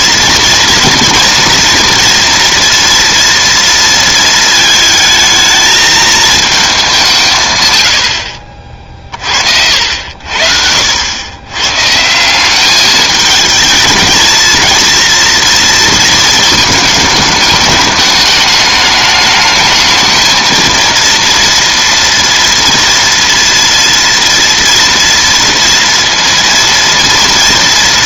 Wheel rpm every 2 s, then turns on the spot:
230, 230, 220, 200, 40, 70, 210, 230, 220, 210, 230, 230, 230, 230.
none